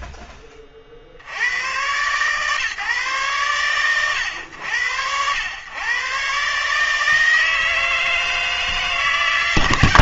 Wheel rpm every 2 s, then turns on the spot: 40, 130, 90, 140, 160.
none